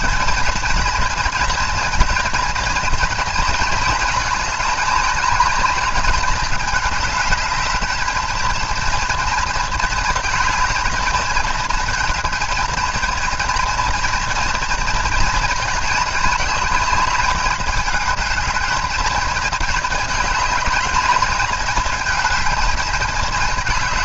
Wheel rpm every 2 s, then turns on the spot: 230, 230, 220, 210, 220, 230, 230, 230, 220, 220, 220, 220.
none